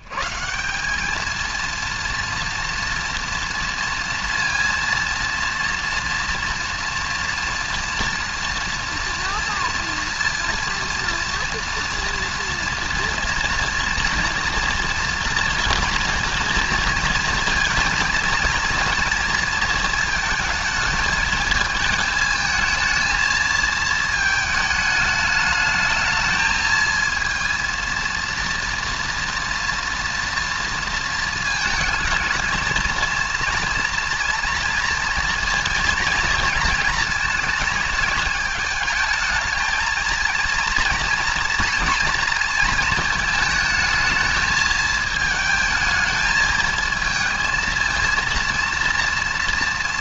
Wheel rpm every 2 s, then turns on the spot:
170, 230, 230, 230, 230, 230, 230, 230, 230, 230, 220, 220, 210, 220, 230, 230, 220, 230, 230, 220, 230, 220, 220, 220, 230.
none